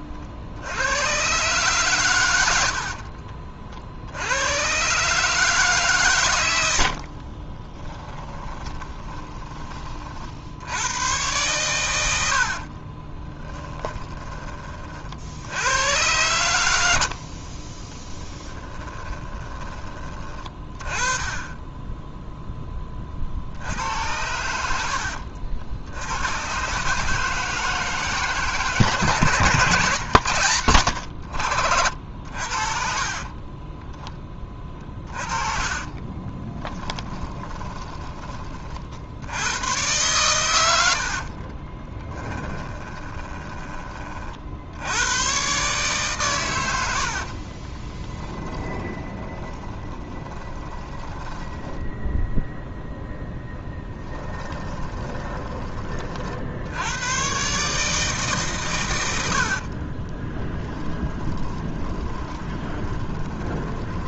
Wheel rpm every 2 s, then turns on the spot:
70, 90, 110, 90, 20, 80, 50, 30, 90, 20, 30, 10, 90, 130, 150, 110, 50, 30, 20, 40, 90, 20, 70, 110, 20, 20, 0, 20, 70, 140, 20, 20.
8-10 12-14 18-20 32-38 42-44 48-52 54-56 60-64